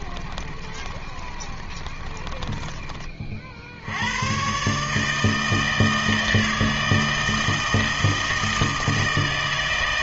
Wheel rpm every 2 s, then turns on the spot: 20, 20, 120, 160, 160.
0-4